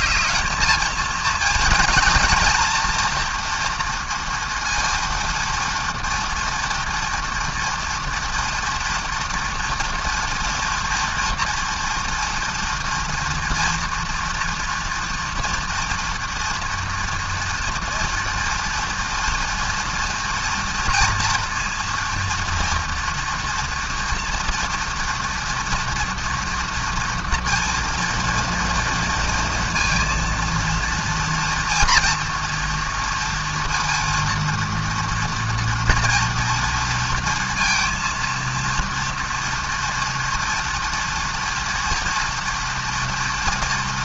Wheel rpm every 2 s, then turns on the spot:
220, 230, 230, 230, 230, 230, 230, 230, 240, 240, 230, 230, 230, 230, 230, 230, 230, 230, 230, 230, 230, 230.
none